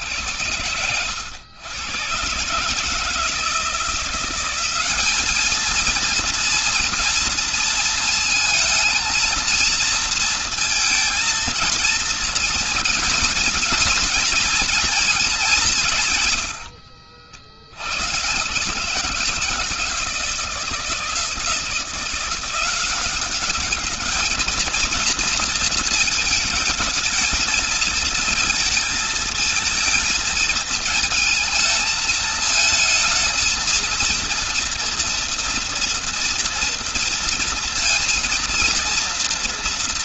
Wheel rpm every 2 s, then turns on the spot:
90, 150, 210, 230, 230, 230, 230, 220, 80, 160, 160, 200, 230, 220, 220, 220, 230, 240, 230, 240.
none